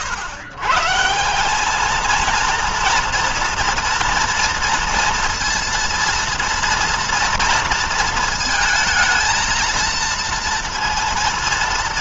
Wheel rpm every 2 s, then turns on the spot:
120, 230, 230, 230, 230, 230.
none